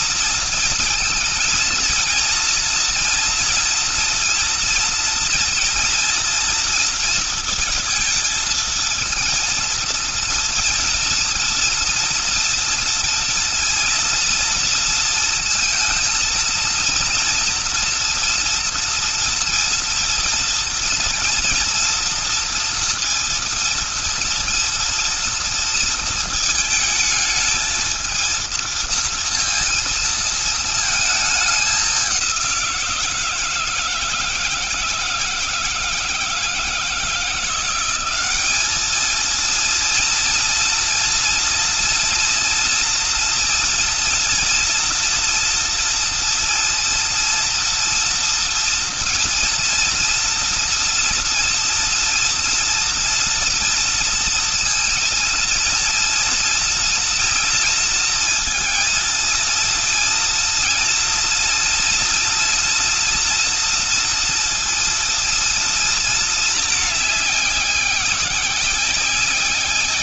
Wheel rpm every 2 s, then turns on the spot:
230, 230, 230, 230, 230, 230, 230, 230, 230, 240, 230, 230, 230, 220, 230, 220, 170, 160, 170, 220, 230, 230, 230, 230, 230, 230, 240, 230, 230, 230, 230, 230, 230, 200, 190.
none